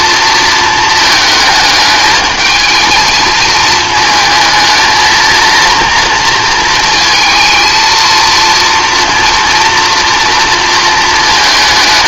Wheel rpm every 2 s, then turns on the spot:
230, 220, 220, 230, 230, 230.
none